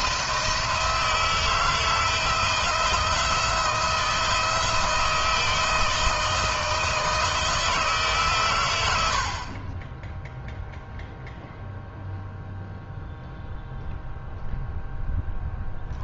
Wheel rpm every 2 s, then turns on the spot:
170, 170, 160, 160, 100, 0, 0, 10.
none